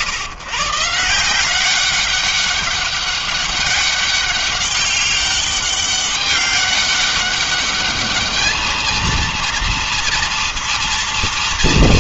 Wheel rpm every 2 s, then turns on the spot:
140, 200, 200, 200, 210, 230.
none